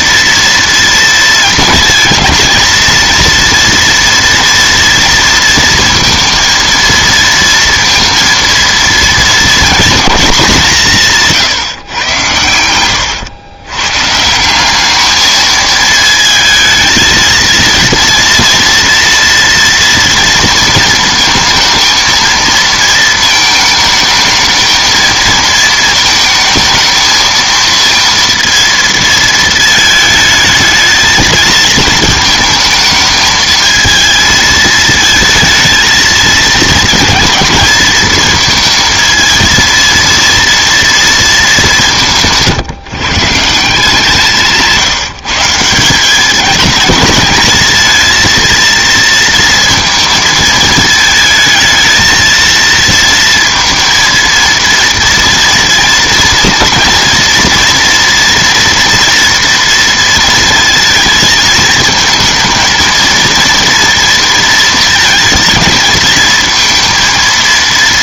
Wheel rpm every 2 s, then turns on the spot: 230, 230, 230, 230, 230, 160, 100, 210, 220, 230, 230, 220, 220, 220, 230, 220, 220, 220, 230, 220, 230, 150, 170, 220, 230, 220, 230, 230, 230, 230, 220, 230, 220, 230.
12-14